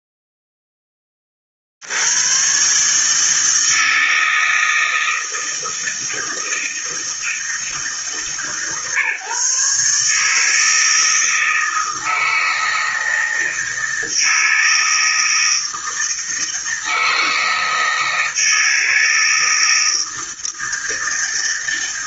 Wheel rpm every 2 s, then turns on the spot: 10, 130, 160, 160, 140, 160, 160, 160, 160, 160, 160.
none